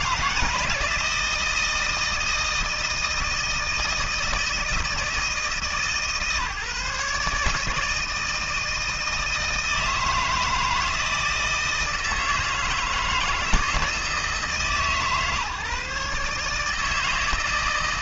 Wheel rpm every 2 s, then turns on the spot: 160, 160, 160, 150, 160, 160, 160, 150, 160.
none